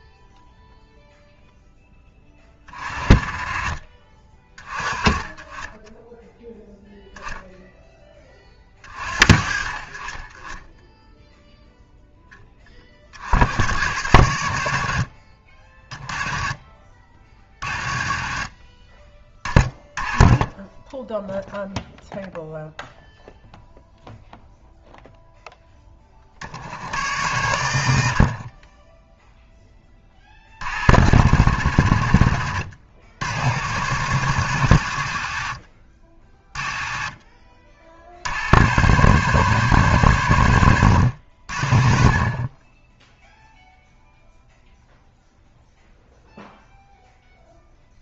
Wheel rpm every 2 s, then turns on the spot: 0, 30, 20, 0, 30, 10, 30, 70, 30, 30, 10, 0, 0, 60, 20, 70, 80, 80, 30, 110, 80, 20, 0, 0.
28-30